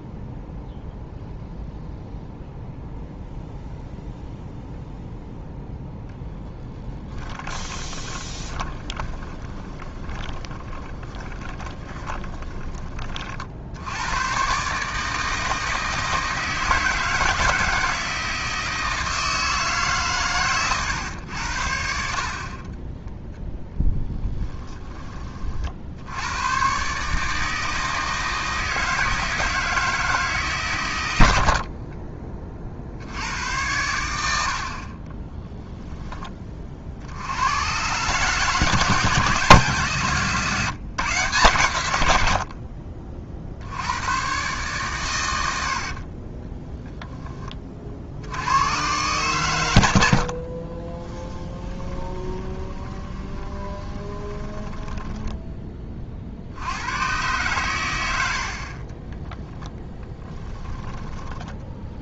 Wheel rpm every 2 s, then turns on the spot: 0, 0, 0, 10, 20, 20, 30, 140, 160, 160, 120, 20, 20, 130, 160, 130, 50, 50, 50, 160, 150, 40, 140, 0, 110, 30, 20, 20, 90, 40, 10.
6-12 22-24 50-56 60-62